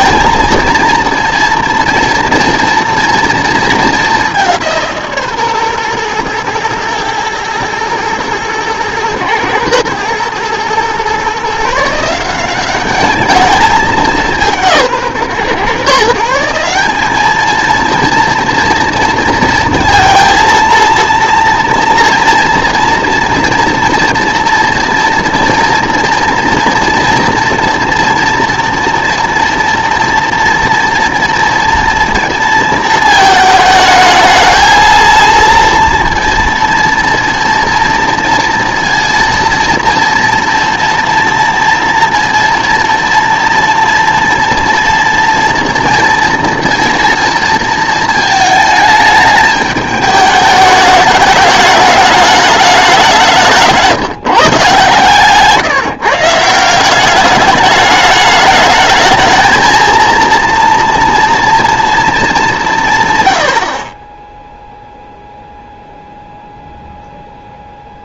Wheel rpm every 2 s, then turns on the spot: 240, 230, 170, 120, 110, 120, 190, 180, 180, 230, 230, 230, 230, 230, 230, 230, 230, 220, 230, 230, 230, 230, 230, 230, 220, 210, 210, 140, 170, 220, 230, 180, 0, 0.
none